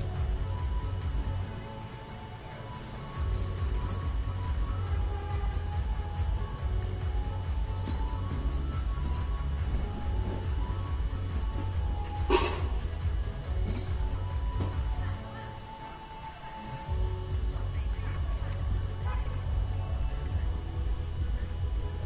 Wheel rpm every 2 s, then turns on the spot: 0, 0, 0, 0, 0, 0, 0, 0, 0, 0, 0.
none